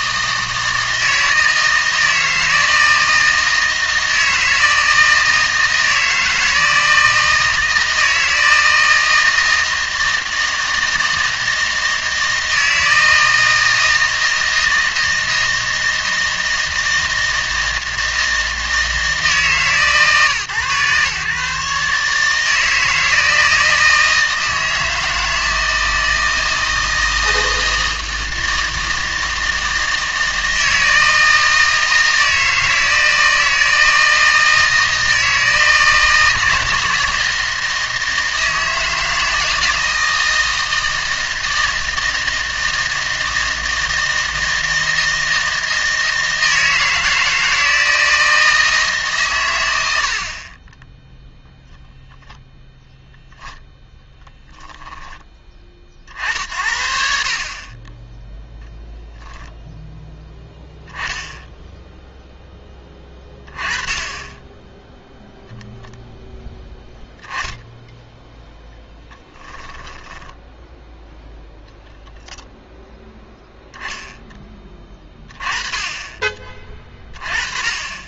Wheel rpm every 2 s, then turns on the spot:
160, 160, 160, 160, 160, 160, 160, 160, 160, 160, 130, 160, 160, 160, 160, 160, 160, 160, 160, 160, 160, 160, 160, 160, 160, 20, 0, 10, 60, 0, 10, 10, 10, 10, 0, 0, 10, 20, 30.
54-56